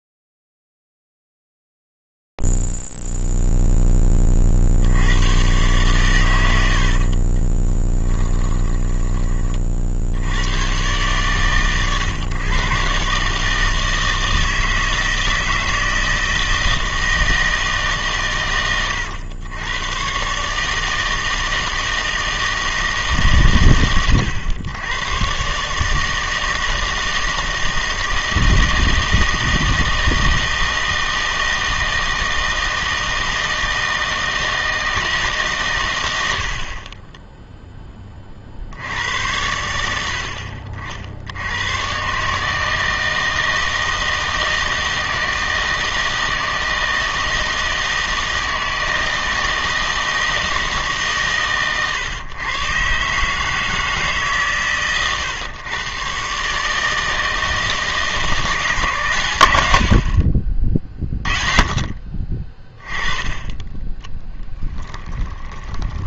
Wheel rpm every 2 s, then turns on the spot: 0, 0, 10, 120, 20, 70, 130, 160, 160, 130, 130, 160, 110, 160, 160, 160, 160, 160, 60, 70, 50, 160, 160, 160, 160, 150, 130, 130, 150, 160, 40, 20, 10.
8-10 64-66